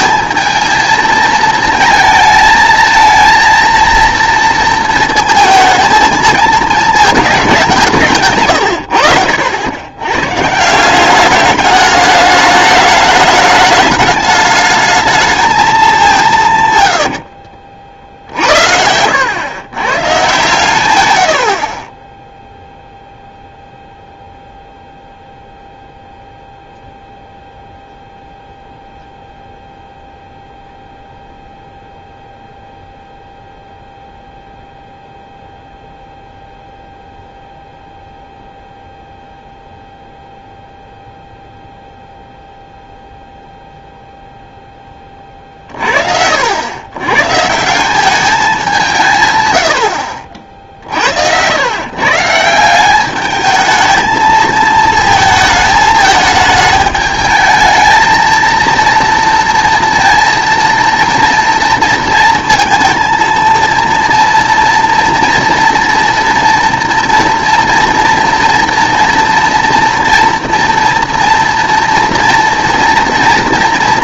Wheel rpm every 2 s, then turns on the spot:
220, 220, 230, 220, 120, 160, 210, 210, 130, 80, 120, 0, 0, 0, 0, 0, 0, 0, 0, 0, 0, 0, 10, 90, 190, 60, 180, 220, 210, 230, 230, 220, 230, 230, 230, 230, 230.
none